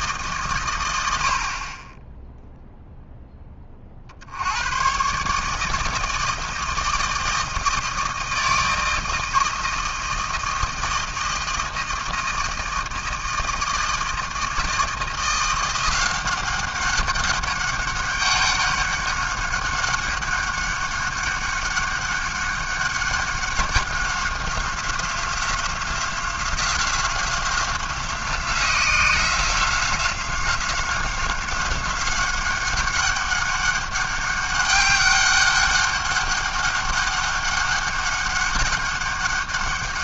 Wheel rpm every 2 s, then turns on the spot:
70, 10, 140, 160, 160, 160, 160, 170, 200, 200, 200, 200, 180, 180, 180, 190, 200, 200, 200, 200.
none